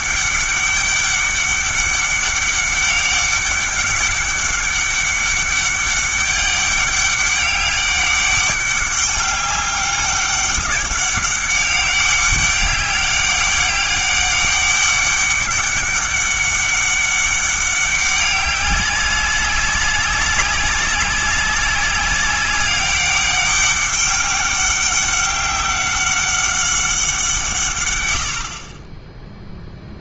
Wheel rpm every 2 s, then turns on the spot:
200, 200, 200, 200, 200, 200, 200, 200, 200, 200, 190, 190, 200, 190, 30.
none